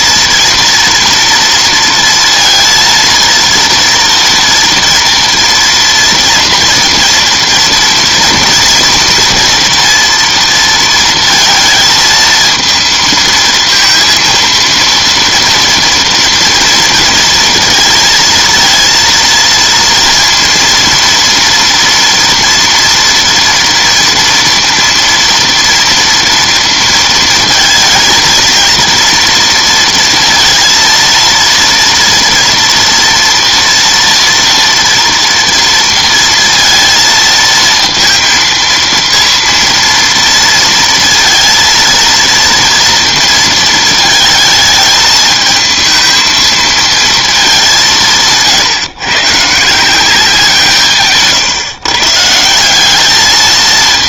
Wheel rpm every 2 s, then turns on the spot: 230, 230, 230, 230, 230, 230, 220, 230, 230, 230, 230, 230, 230, 230, 230, 230, 230, 240, 230, 230, 230, 230, 220, 230, 150, 180, 170.
none